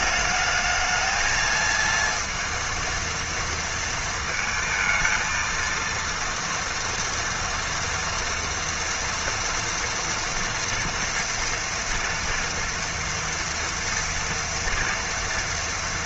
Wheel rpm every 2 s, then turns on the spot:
220, 230, 220, 230, 230, 230, 230, 230.
none